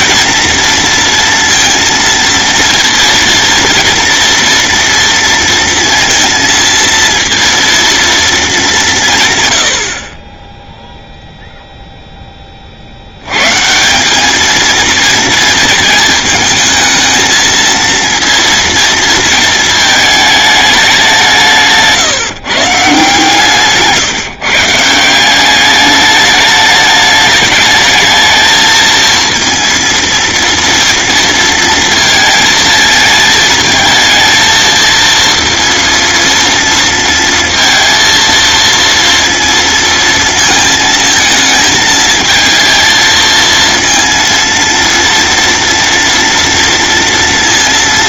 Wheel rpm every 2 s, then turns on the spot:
230, 230, 230, 230, 180, 0, 70, 230, 220, 230, 190, 160, 170, 210, 220, 230, 220, 230, 230, 230, 220, 230, 230, 230.
none